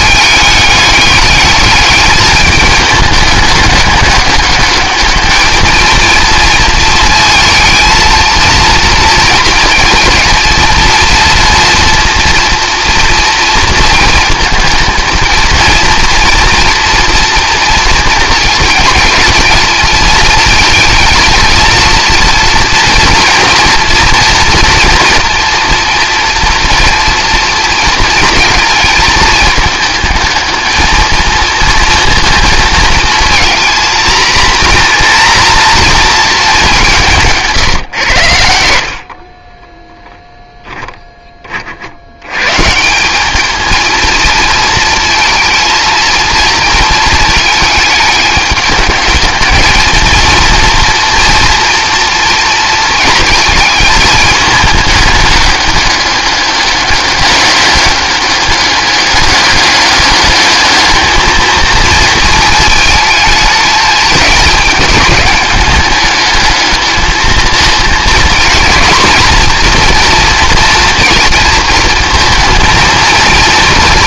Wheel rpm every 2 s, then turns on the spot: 210, 210, 210, 230, 230, 230, 240, 230, 240, 230, 230, 240, 230, 230, 230, 220, 220, 240, 200, 70, 10, 160, 230, 220, 210, 230, 230, 210, 200, 200, 210, 220, 210, 220, 230, 240, 230.
38-40